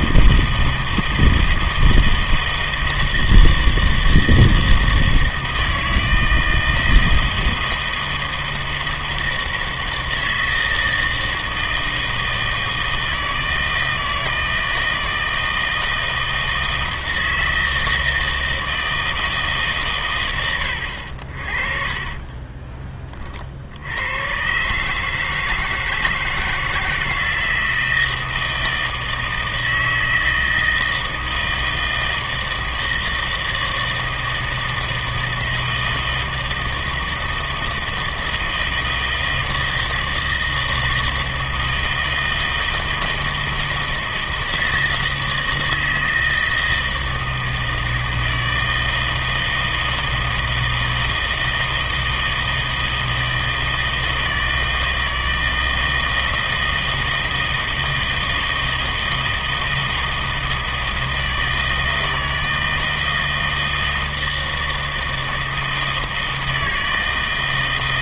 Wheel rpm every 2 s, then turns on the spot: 160, 160, 160, 160, 160, 160, 160, 160, 160, 160, 80, 20, 140, 170, 160, 160, 160, 160, 160, 160, 160, 160, 160, 160, 160, 160, 160, 160, 160, 160, 160, 160, 160, 160.
none